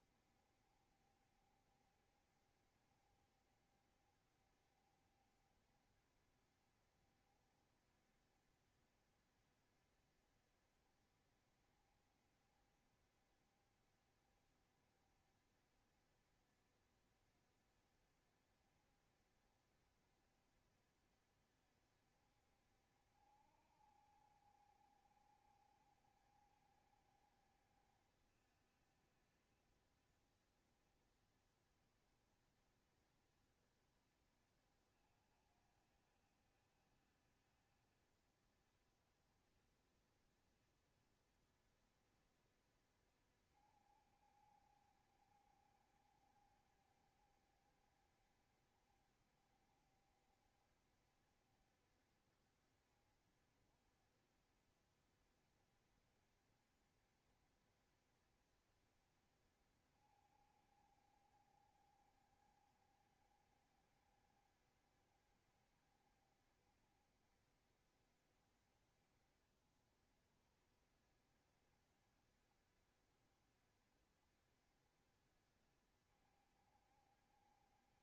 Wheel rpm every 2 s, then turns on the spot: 70, 70, 60, 60, 70, 70, 70, 70, 60, 70, 70, 60, 70, 60, 70, 70, 60, 70, 70, 70, 70, 60, 70, 70, 60, 70, 60, 60, 70, 70, 70, 60, 70, 60, 50, 60, 70, 60, 70.
none